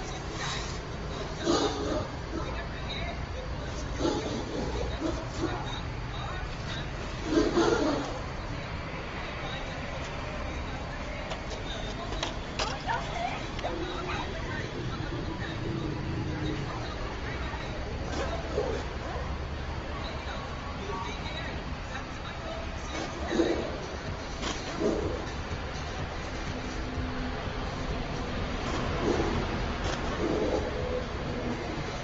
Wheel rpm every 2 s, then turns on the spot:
0, 0, 0, 0, 0, 0, 0, 0, 0, 0, 0, 0, 0, 0, 0, 0.
none